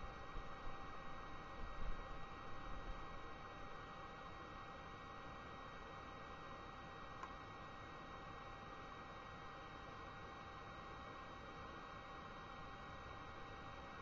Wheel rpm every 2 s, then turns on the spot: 0, 0, 0, 0, 0, 0, 0.
none